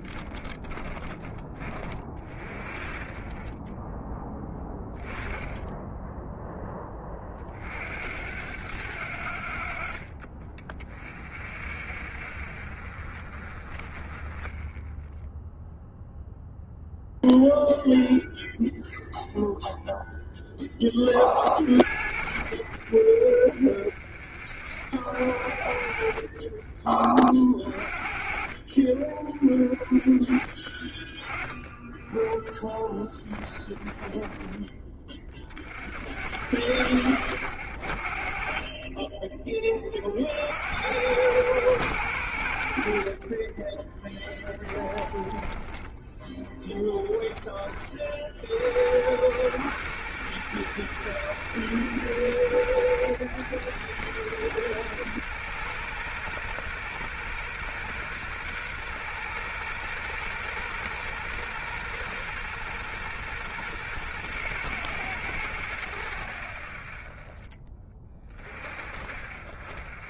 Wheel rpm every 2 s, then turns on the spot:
20, 30, 10, 20, 80, 30, 50, 10, 0, 0, 20, 20, 50, 30, 30, 30, 10, 40, 50, 30, 90, 60, 10, 10, 80, 120, 100, 120, 120, 120, 120, 120, 110, 50, 40.
0-2 14-16 22-24 32-34 44-48